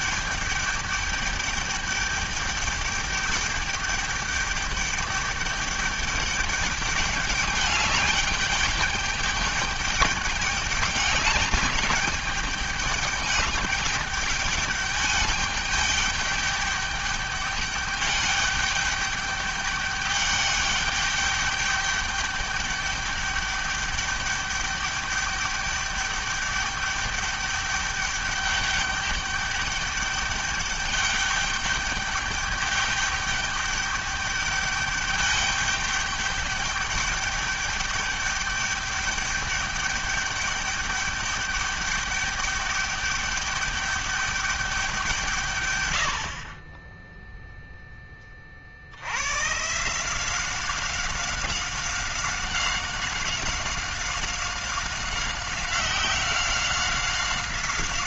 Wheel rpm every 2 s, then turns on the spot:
210, 210, 200, 200, 200, 200, 210, 210, 210, 210, 210, 210, 210, 200, 200, 200, 200, 210, 210, 200, 210, 200, 200, 60, 30, 180, 190, 190, 190.
none